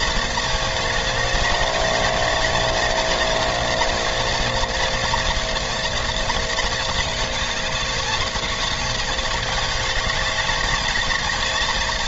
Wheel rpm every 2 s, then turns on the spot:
220, 220, 230, 220, 210, 210.
none